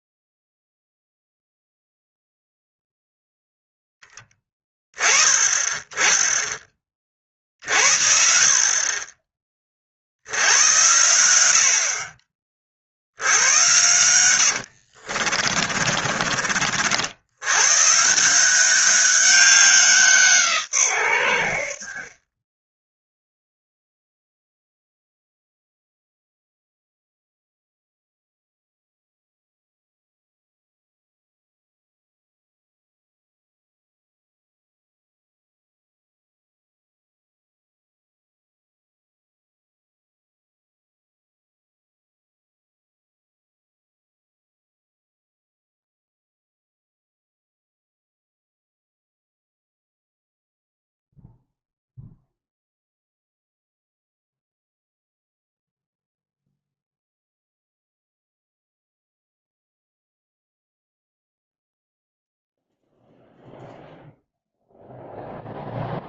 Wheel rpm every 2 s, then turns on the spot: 0, 0, 20, 20, 50, 90, 50, 80, 50, 190, 150, 10, 0, 0, 0, 0, 0, 0, 0, 0, 0, 0, 0, 0, 0, 0, 0, 0, 0, 0, 0, 0, 0.
14-16